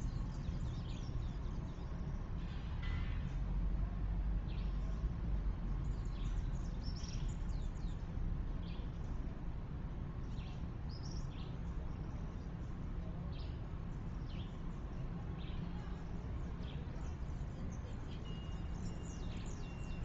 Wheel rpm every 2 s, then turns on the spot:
0, 0, 0, 0, 0, 0, 0, 0, 0, 0.
none